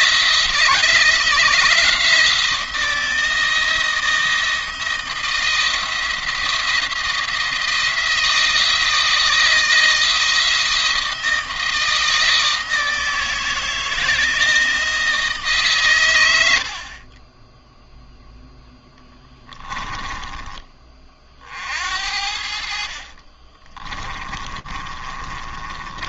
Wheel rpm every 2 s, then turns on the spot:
160, 170, 170, 170, 160, 160, 160, 160, 50, 10, 30, 50, 30.
18-20 22-26